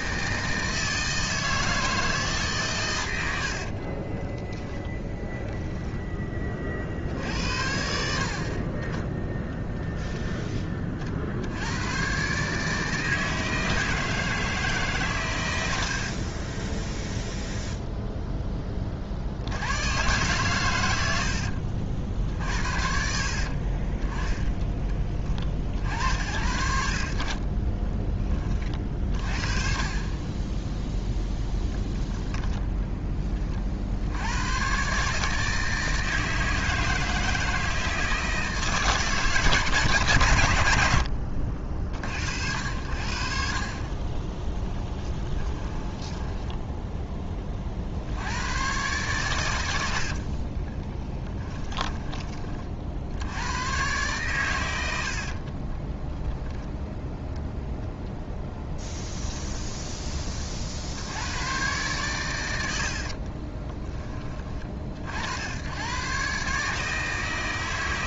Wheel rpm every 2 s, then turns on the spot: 160, 130, 10, 40, 30, 20, 150, 150, 10, 20, 120, 60, 20, 70, 30, 10, 10, 120, 160, 150, 90, 80, 20, 10, 120, 20, 50, 100, 10, 10, 60, 80, 40, 150.
30-32 44-48 50-52 58-60 62-64